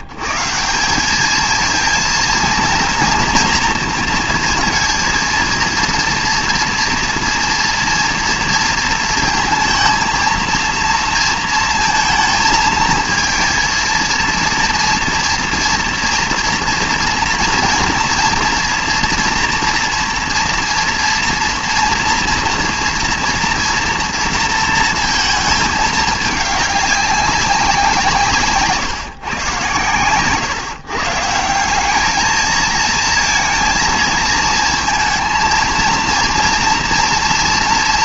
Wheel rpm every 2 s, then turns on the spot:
150, 230, 230, 230, 230, 230, 220, 230, 230, 230, 230, 230, 230, 210, 160, 140, 220, 220, 230.
none